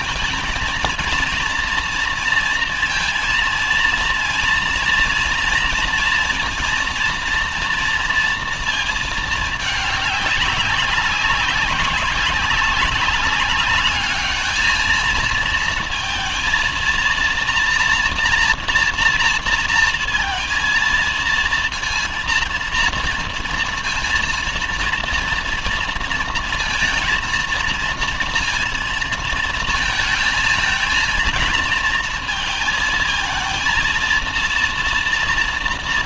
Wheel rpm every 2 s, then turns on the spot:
230, 230, 230, 230, 230, 200, 190, 220, 230, 230, 230, 230, 230, 230, 230, 220, 220, 230.
none